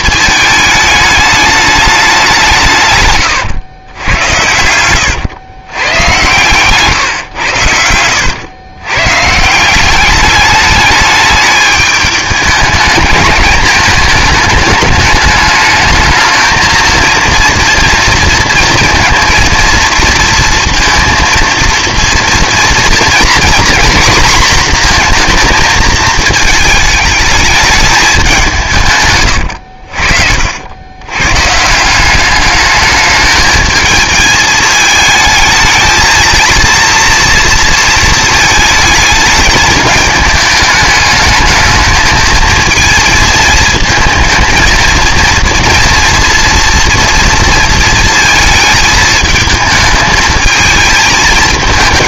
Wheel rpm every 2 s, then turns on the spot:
220, 150, 100, 130, 110, 210, 210, 210, 220, 230, 230, 230, 240, 220, 170, 80, 210, 220, 230, 220, 210, 220, 220, 230, 230, 220.
4-6